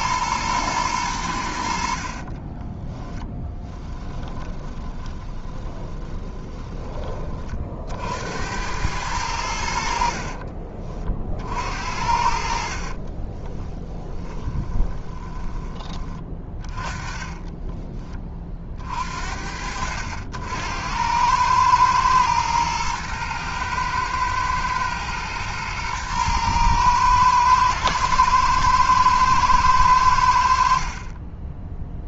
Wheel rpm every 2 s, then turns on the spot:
100, 10, 20, 20, 100, 40, 30, 20, 20, 60, 90, 110, 110, 110, 110, 30.
2-6 12-18